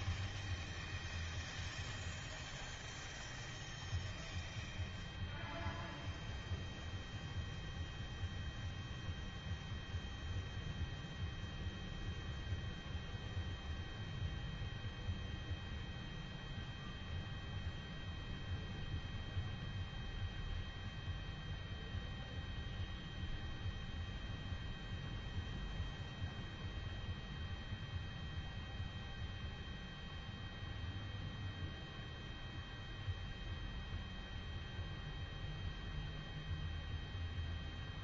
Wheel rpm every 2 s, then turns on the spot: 0, 0, 0, 0, 0, 0, 0, 0, 0, 0, 0, 0, 0, 0, 0, 0, 0, 0, 0.
none